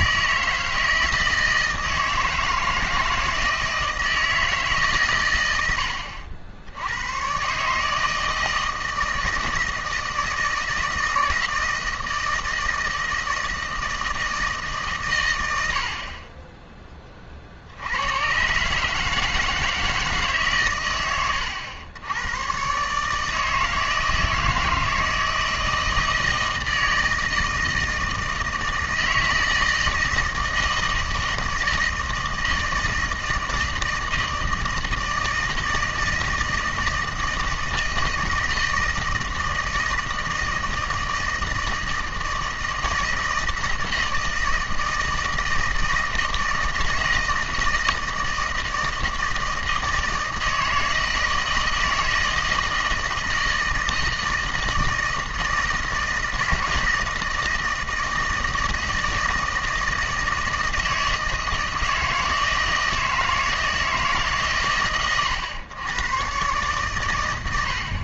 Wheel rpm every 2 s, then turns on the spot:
160, 160, 140, 80, 160, 160, 160, 150, 10, 130, 130, 120, 160, 160, 160, 160, 160, 160, 160, 160, 160, 160, 160, 160, 160, 160, 160, 160, 160, 160, 160, 160, 130, 130.
none